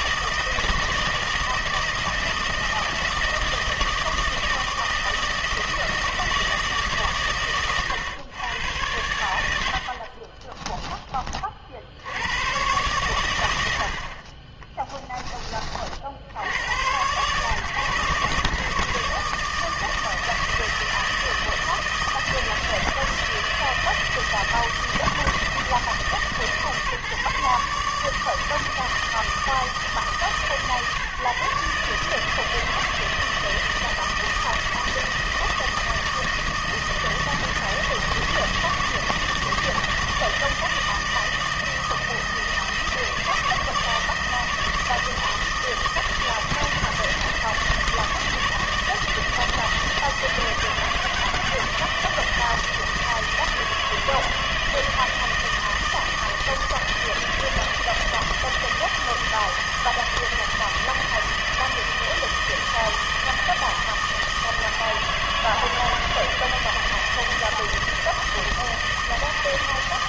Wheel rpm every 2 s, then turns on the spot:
160, 160, 160, 150, 110, 30, 120, 20, 120, 150, 160, 160, 160, 150, 160, 140, 160, 160, 160, 160, 160, 160, 160, 160, 160, 160, 160, 160, 160, 160, 160, 160, 160, 160, 160.
10-12 14-16